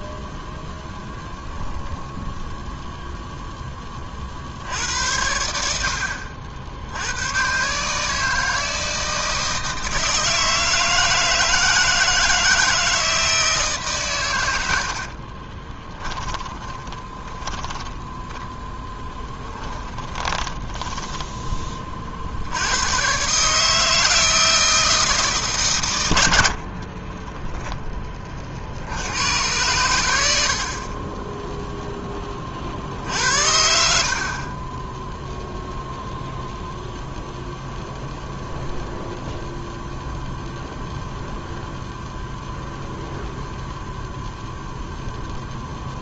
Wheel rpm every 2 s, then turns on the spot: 0, 0, 90, 90, 160, 160, 160, 50, 30, 10, 10, 110, 160, 30, 70, 40, 50, 10, 0, 0, 0, 0, 0.
14-22 26-28